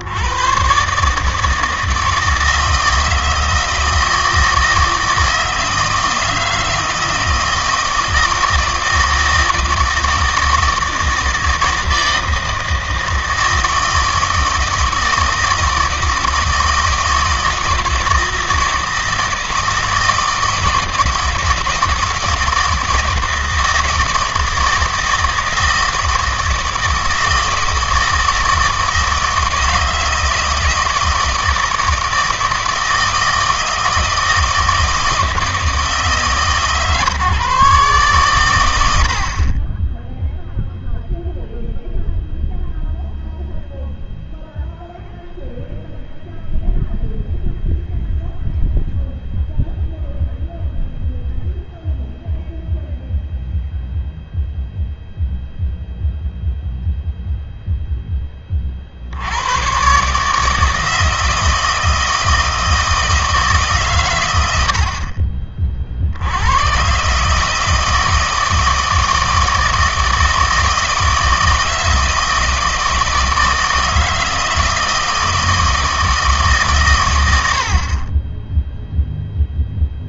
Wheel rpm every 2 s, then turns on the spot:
120, 160, 160, 160, 160, 160, 160, 160, 160, 160, 160, 160, 160, 160, 160, 160, 160, 160, 140, 100, 0, 0, 0, 0, 0, 0, 0, 0, 0, 40, 160, 160, 80, 110, 160, 160, 160, 160, 130, 0.
none